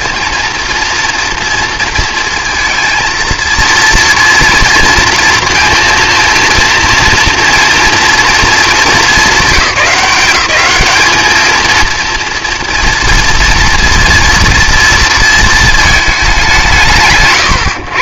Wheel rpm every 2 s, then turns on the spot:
240, 230, 230, 230, 220, 200, 240, 230, 130.
none